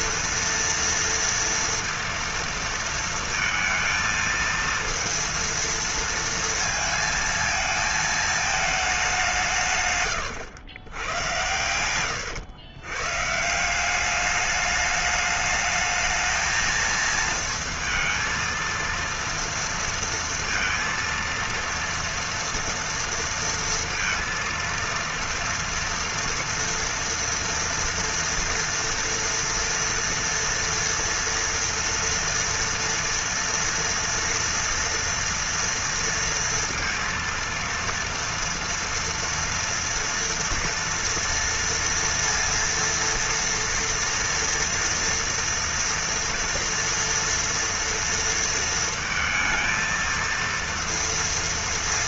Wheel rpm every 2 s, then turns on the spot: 230, 230, 230, 230, 210, 90, 110, 210, 220, 230, 230, 230, 230, 230, 230, 230, 230, 230, 230, 240, 230, 230, 230, 230, 230, 230.
none